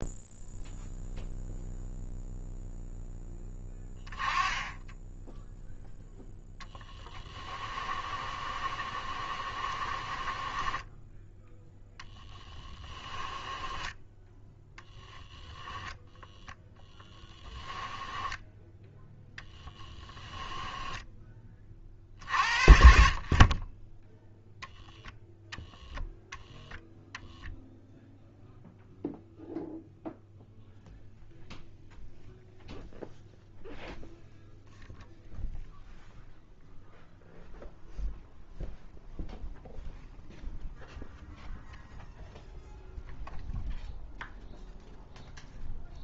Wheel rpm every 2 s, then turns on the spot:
0, 0, 10, 10, 30, 10, 30, 10, 10, 0, 10, 50, 10, 0, 0, 0, 0, 0, 0, 0, 0, 0, 0.
6-18 20-22